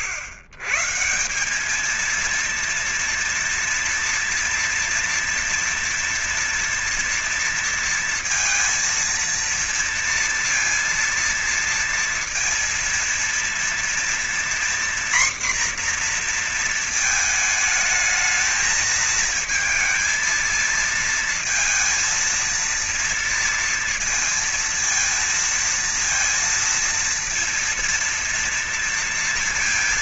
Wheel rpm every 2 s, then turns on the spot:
110, 230, 230, 230, 230, 230, 230, 240, 240, 220, 220, 230, 230, 230, 230.
none